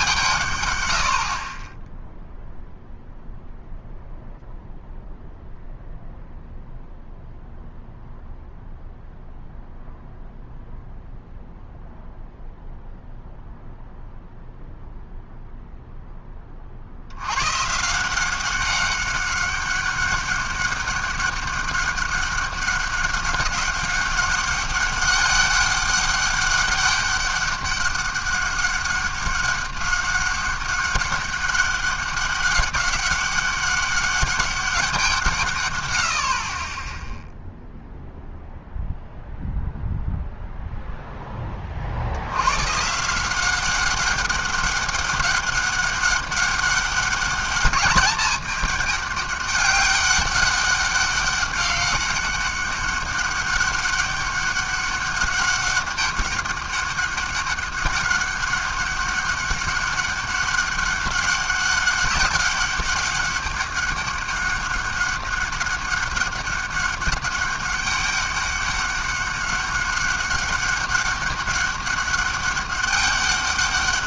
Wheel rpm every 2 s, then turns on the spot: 130, 0, 0, 0, 0, 0, 0, 0, 30, 190, 200, 200, 200, 200, 200, 190, 190, 200, 40, 0, 0, 110, 200, 200, 210, 200, 200, 200, 200, 190, 200, 200, 200, 200, 200, 200, 200.
none